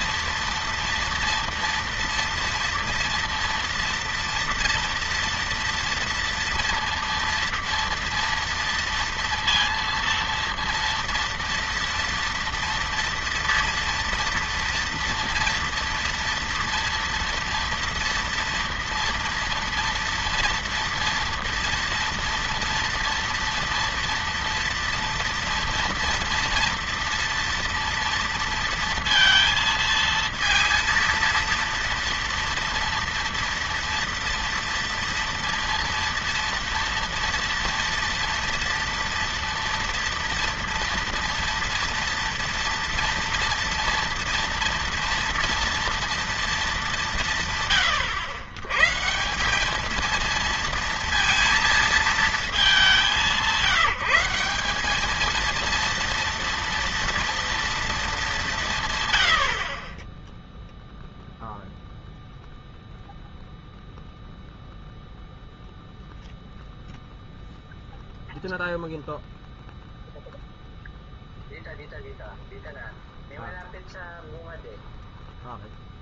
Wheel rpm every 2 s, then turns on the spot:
230, 230, 230, 230, 230, 230, 240, 230, 230, 230, 230, 230, 230, 230, 230, 230, 230, 230, 230, 230, 230, 230, 230, 210, 130, 230, 200, 190, 230, 170, 0, 0, 0, 0, 0, 0, 0, 0.
none